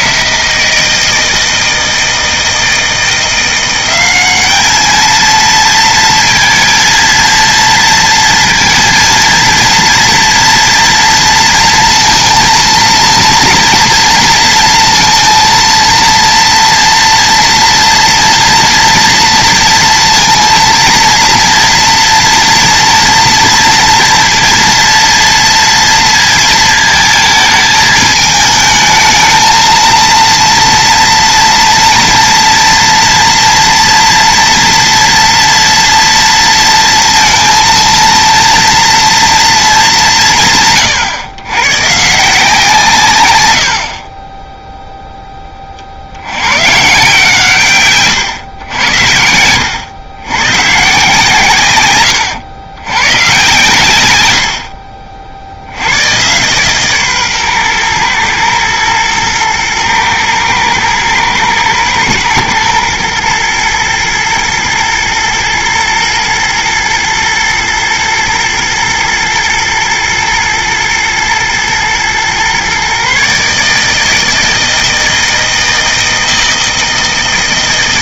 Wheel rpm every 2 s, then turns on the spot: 160, 170, 220, 230, 230, 230, 230, 230, 230, 230, 230, 230, 230, 220, 220, 230, 240, 240, 230, 230, 140, 150, 0, 140, 90, 140, 120, 60, 140, 110, 110, 110, 110, 110, 110, 120, 130, 160, 160.
48-50